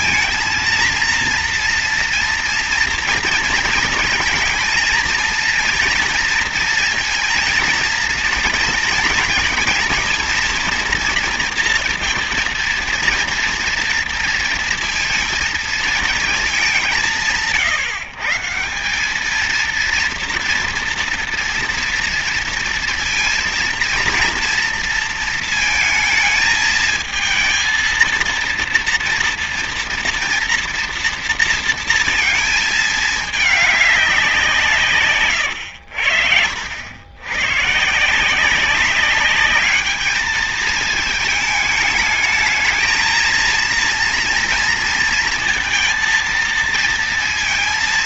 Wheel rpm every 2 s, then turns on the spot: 230, 230, 230, 230, 230, 230, 230, 230, 210, 160, 230, 230, 230, 220, 230, 230, 220, 180, 80, 170, 210, 220, 230, 230.
none